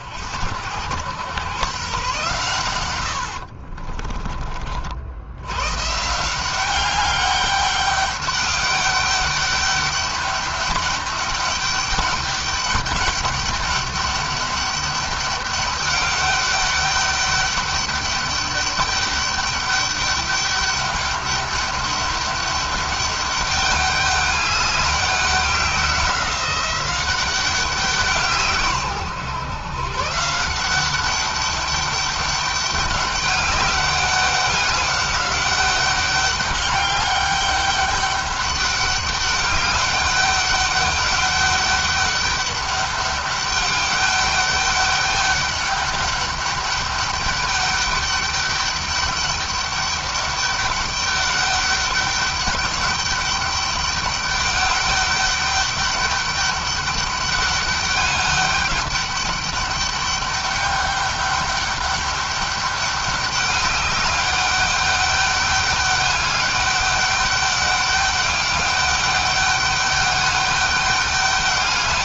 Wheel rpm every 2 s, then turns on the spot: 100, 110, 60, 190, 200, 200, 200, 200, 200, 200, 200, 200, 200, 190, 150, 190, 200, 200, 200, 200, 200, 200, 200, 200, 200, 200, 200, 200, 200, 200, 200, 200, 200, 200, 200, 200.
2-4